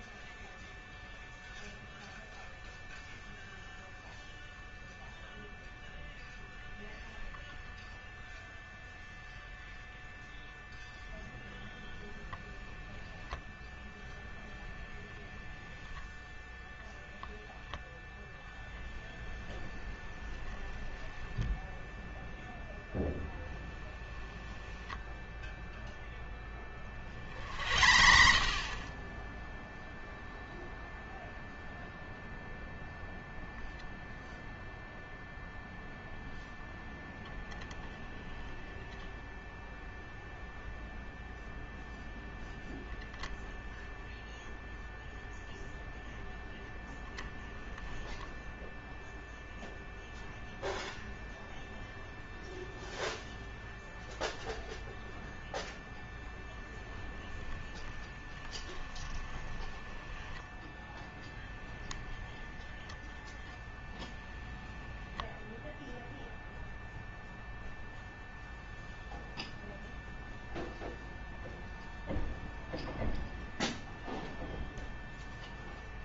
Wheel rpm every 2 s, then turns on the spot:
0, 0, 0, 0, 0, 0, 10, 0, 0, 10, 10, 10, 10, 30, 20, 0, 0, 0, 0, 10, 0, 0, 0, 10, 0, 0, 0, 0, 10, 10, 10, 10, 10, 0, 0, 0, 0, 0.
24-26 58-60